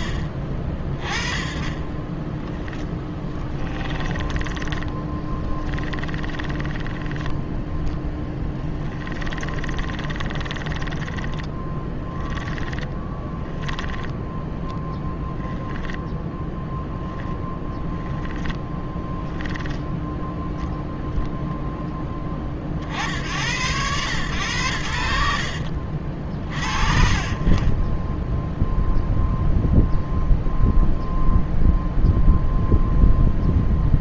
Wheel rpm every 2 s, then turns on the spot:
30, 10, 20, 10, 20, 20, 10, 10, 10, 10, 0, 60, 80, 50, 0, 0, 0.
2-14 16-20